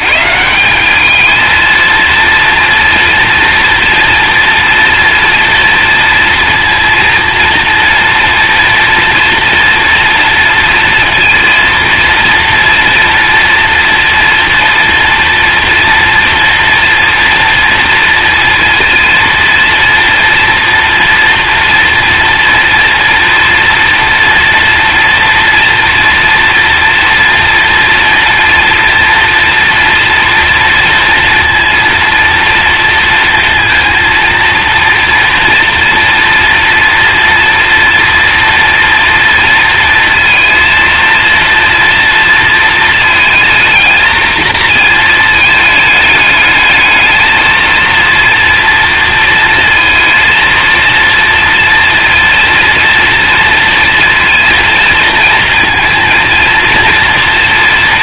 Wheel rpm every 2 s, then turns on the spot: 210, 230, 230, 230, 230, 230, 240, 230, 230, 230, 230, 230, 240, 230, 230, 230, 230, 230, 240, 230, 230, 230, 220, 220, 230, 230, 230, 230, 230.
none